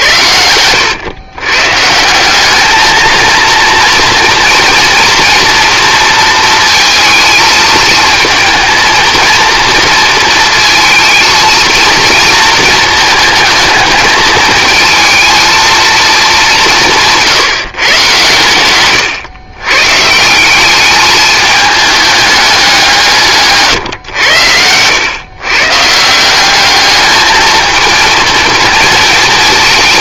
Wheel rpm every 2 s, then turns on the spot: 110, 220, 240, 230, 230, 230, 220, 220, 180, 130, 200, 190, 100, 210, 220.
18-20